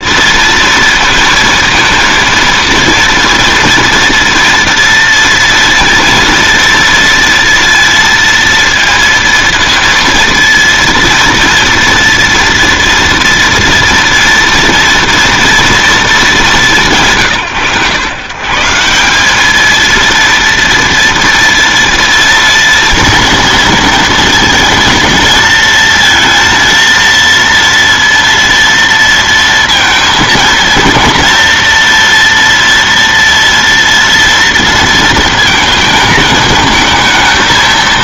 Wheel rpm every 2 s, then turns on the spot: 230, 230, 230, 230, 230, 230, 230, 240, 160, 190, 230, 230, 230, 230, 230, 230, 230, 230, 220.
none